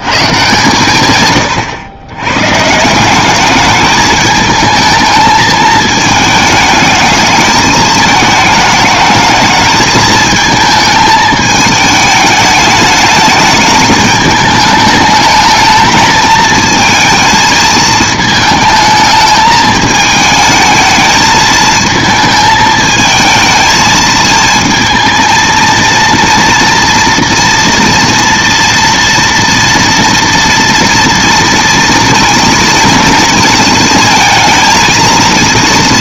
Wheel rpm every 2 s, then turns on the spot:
140, 150, 220, 220, 220, 220, 210, 210, 220, 220, 220, 220, 230, 230, 230, 230, 230, 230.
none